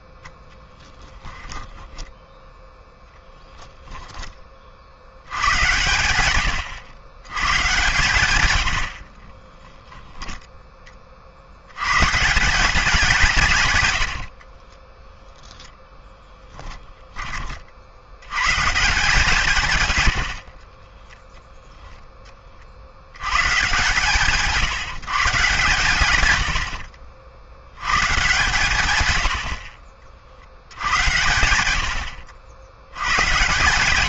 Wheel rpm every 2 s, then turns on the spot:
10, 10, 100, 120, 30, 60, 160, 0, 30, 160, 0, 100, 150, 60, 100, 80, 110.
0-2 8-10 28-30